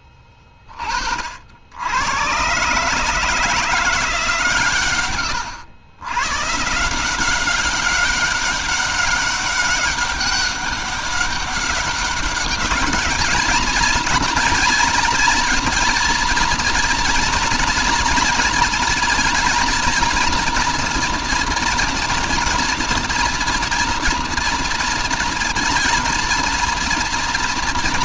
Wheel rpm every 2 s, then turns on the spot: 30, 130, 140, 150, 200, 200, 210, 230, 230, 230, 230, 230, 230, 230.
none